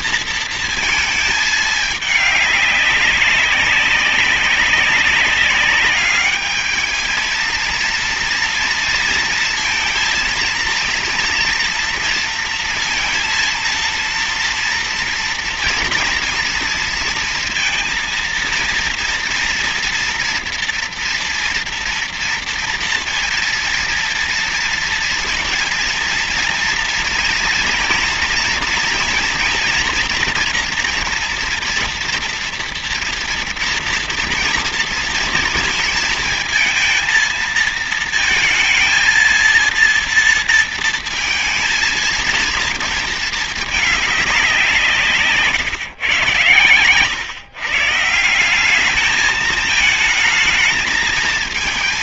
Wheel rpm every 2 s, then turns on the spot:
230, 210, 190, 210, 230, 230, 230, 230, 230, 230, 240, 230, 230, 230, 230, 230, 230, 230, 230, 230, 230, 230, 190, 110, 160, 220.
none